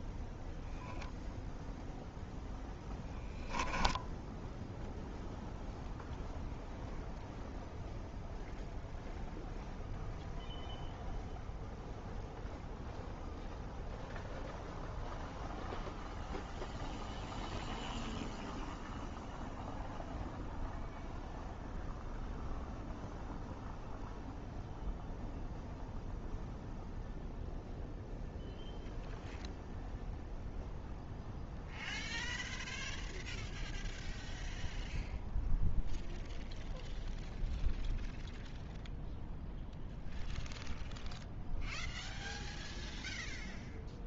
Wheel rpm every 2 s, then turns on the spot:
0, 10, 0, 0, 0, 0, 0, 0, 0, 0, 0, 0, 0, 0, 0, 0, 0, 0, 0, 0, 0, 0.
none